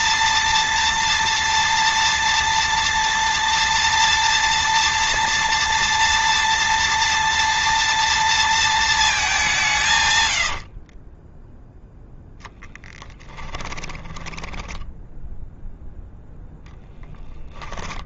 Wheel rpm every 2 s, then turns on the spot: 230, 230, 230, 230, 210, 20, 10, 10, 0.
10-16